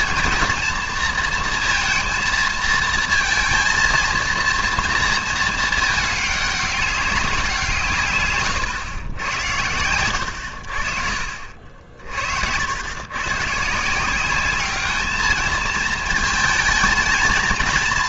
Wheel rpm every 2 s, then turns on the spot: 230, 220, 230, 200, 130, 70, 80, 200, 220.
8-10